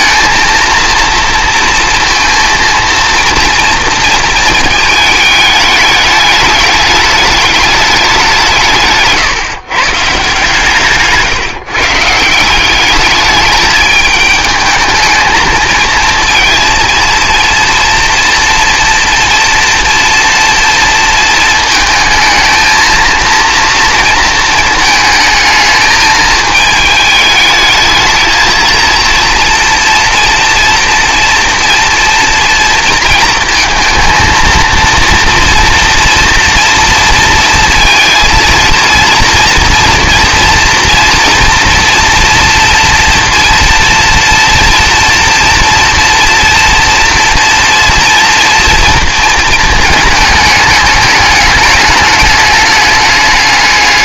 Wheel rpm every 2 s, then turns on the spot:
230, 230, 230, 210, 170, 150, 170, 210, 230, 230, 230, 220, 230, 220, 220, 230, 240, 230, 230, 230, 230, 230, 240, 230, 240, 210, 210.
none